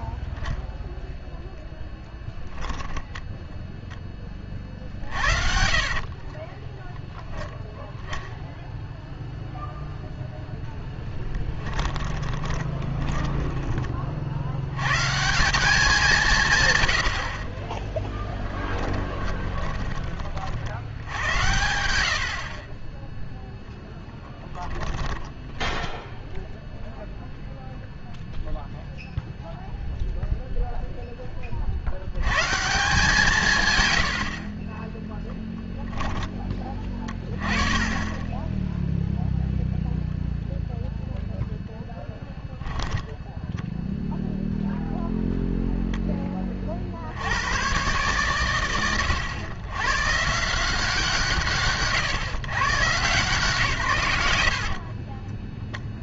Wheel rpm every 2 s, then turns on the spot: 0, 0, 50, 10, 0, 0, 10, 100, 110, 10, 80, 30, 10, 0, 0, 0, 160, 30, 20, 0, 0, 10, 0, 60, 80, 170, 130, 10.
4-6 12-14 18-20 24-26 42-44 54-56